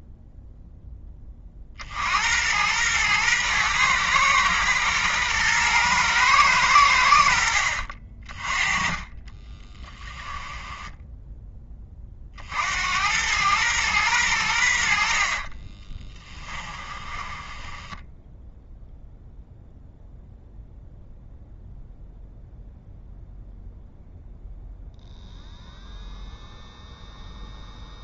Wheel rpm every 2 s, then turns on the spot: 20, 110, 120, 80, 20, 10, 90, 60, 20, 0, 0, 0, 0, 0.
8-12 16-18